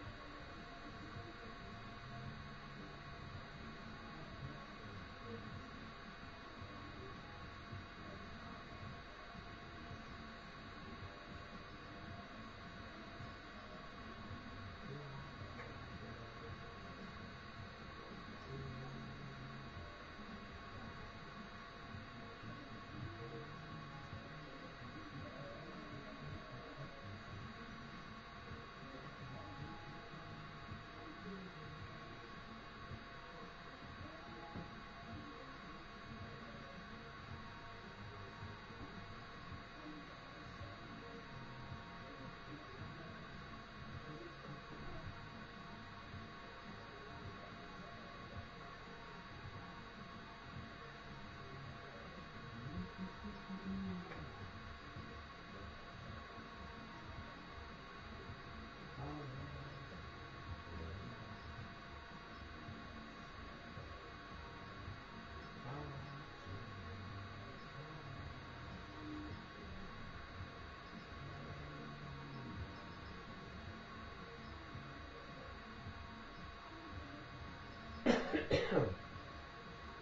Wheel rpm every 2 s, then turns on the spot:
0, 0, 0, 0, 0, 0, 0, 0, 0, 0, 0, 0, 0, 0, 0, 0, 0, 0, 0, 0, 0, 0, 0, 0, 0, 0, 0, 0, 0, 0, 0, 0, 0, 0, 0, 0, 0, 0, 0, 0.
none